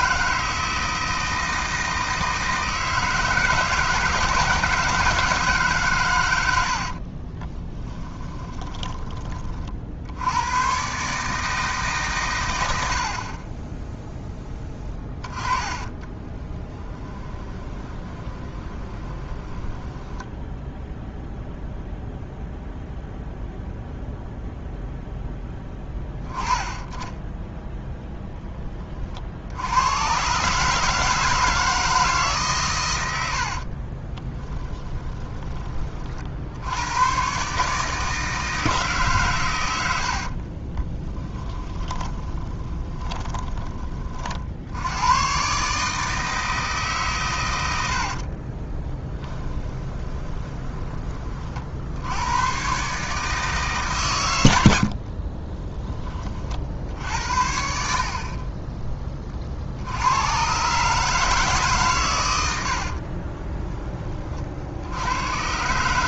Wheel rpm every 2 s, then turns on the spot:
160, 160, 160, 80, 10, 110, 80, 10, 30, 20, 0, 0, 0, 10, 10, 140, 130, 10, 80, 160, 40, 20, 60, 160, 30, 20, 120, 100, 50, 30, 120, 70, 60.
8-10 14-20 34-36 40-44 48-52 62-64